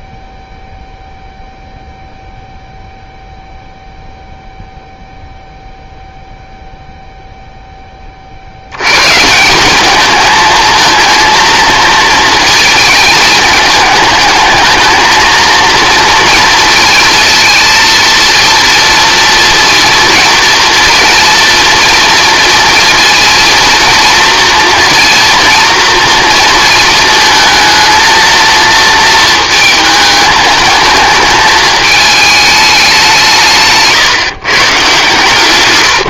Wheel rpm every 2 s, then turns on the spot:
0, 0, 0, 0, 100, 230, 220, 220, 230, 230, 230, 230, 230, 230, 220, 220, 200, 140.
none